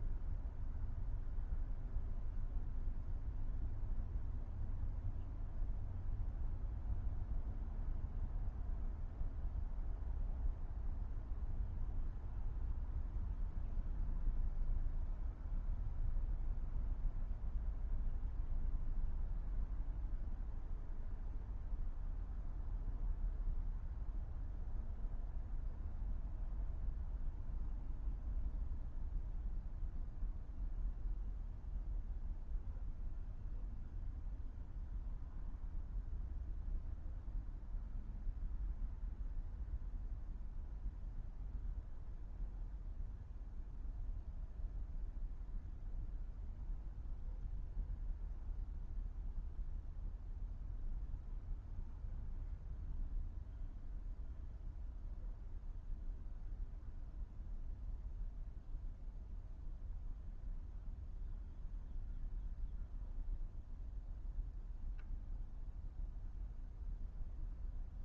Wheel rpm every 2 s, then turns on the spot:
0, 0, 0, 0, 0, 0, 0, 0, 0, 0, 0, 0, 0, 0, 0, 0, 0, 0, 0, 0, 0, 0, 0, 0, 0, 0, 0, 0, 0, 0, 0, 0, 0, 0.
none